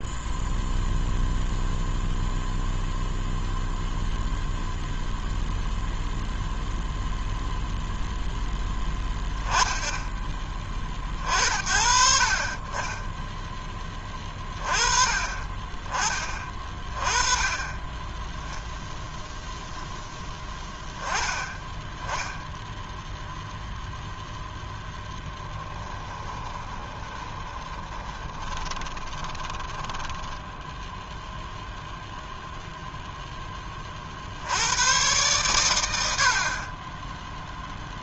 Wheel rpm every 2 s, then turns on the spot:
0, 0, 0, 0, 10, 30, 10, 30, 20, 0, 10, 0, 10, 20, 20, 0, 0, 120, 10.
26-30